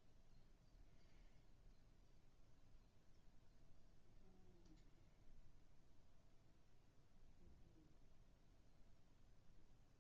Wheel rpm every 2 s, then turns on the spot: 0, 0, 0, 0, 0.
none